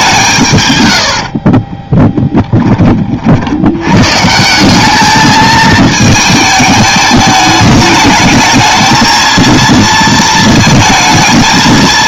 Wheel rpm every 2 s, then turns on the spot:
110, 20, 190, 210, 220, 220.
none